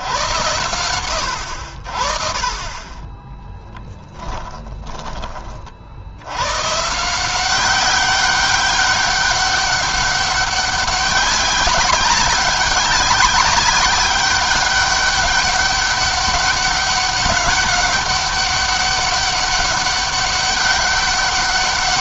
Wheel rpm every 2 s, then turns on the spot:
110, 20, 20, 140, 200, 190, 190, 200, 200, 200, 200.
4-6